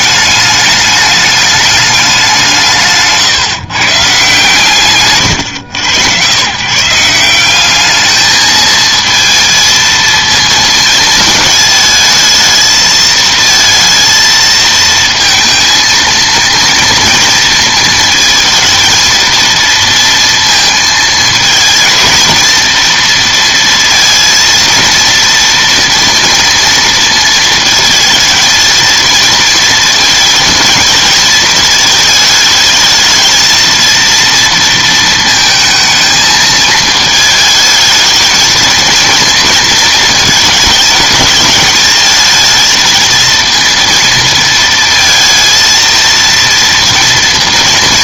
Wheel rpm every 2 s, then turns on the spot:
210, 160, 140, 140, 220, 220, 220, 230, 230, 220, 230, 230, 230, 230, 230, 230, 220, 230, 220, 220, 220, 220, 220, 230.
none